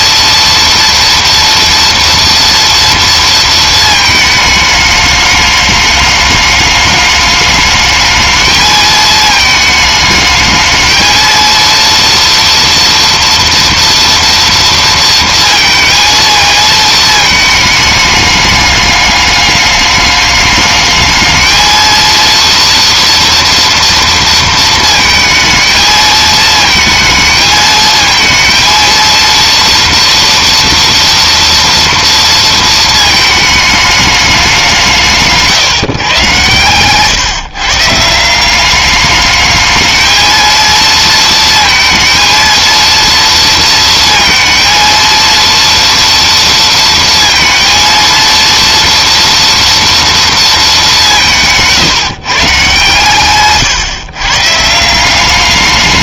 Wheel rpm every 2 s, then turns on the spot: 230, 230, 210, 210, 220, 220, 230, 230, 220, 210, 210, 230, 220, 220, 230, 230, 220, 180, 120, 200, 230, 230, 230, 230, 230, 210, 150, 160.
none